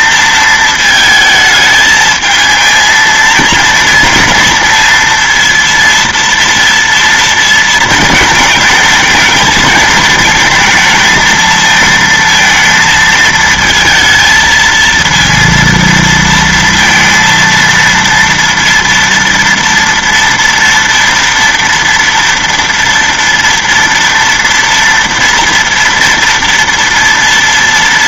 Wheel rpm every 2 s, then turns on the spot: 230, 220, 230, 230, 220, 220, 230, 230, 230, 230, 230, 230, 230, 230.
none